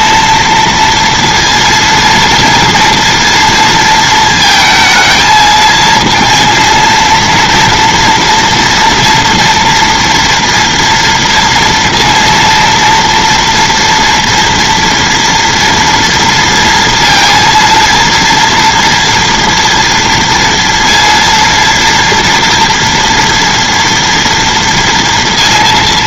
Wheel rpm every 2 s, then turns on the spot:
230, 230, 220, 230, 240, 230, 230, 230, 230, 240, 230, 230, 230.
none